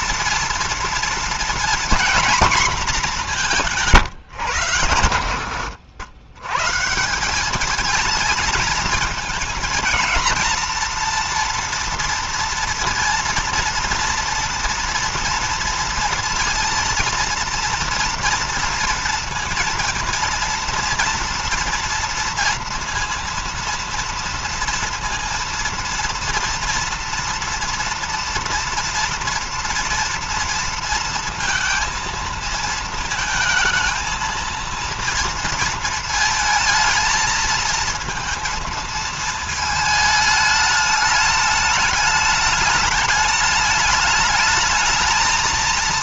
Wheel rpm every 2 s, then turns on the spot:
230, 230, 100, 140, 220, 240, 230, 230, 230, 230, 230, 230, 230, 230, 230, 230, 230, 230, 220, 230, 210, 210, 220.
none